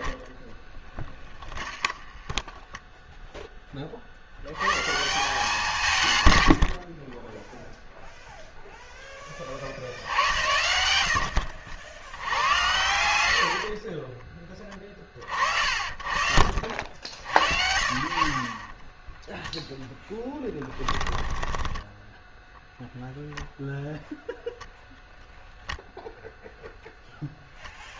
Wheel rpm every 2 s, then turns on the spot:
10, 10, 140, 50, 0, 90, 90, 20, 60, 10, 10, 0, 0, 0.
0-4 6-8 18-22